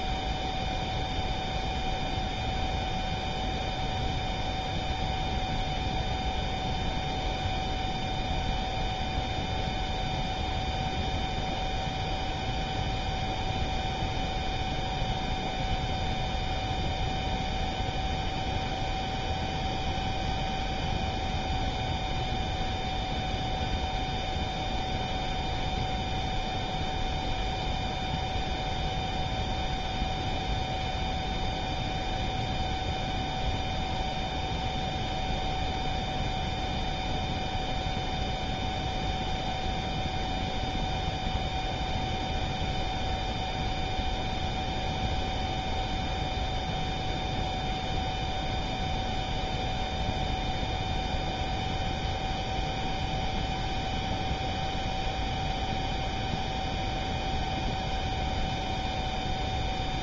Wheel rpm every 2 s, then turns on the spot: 0, 0, 0, 0, 0, 0, 0, 0, 0, 0, 0, 0, 0, 0, 0, 0, 0, 0, 0, 0, 0, 0, 0, 0, 0, 0, 0, 0, 0, 0.
none